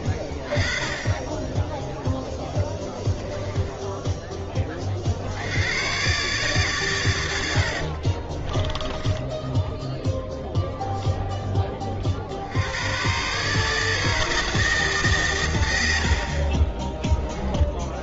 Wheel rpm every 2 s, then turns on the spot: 20, 10, 30, 130, 20, 0, 80, 160, 30.
2-4 8-10 16-18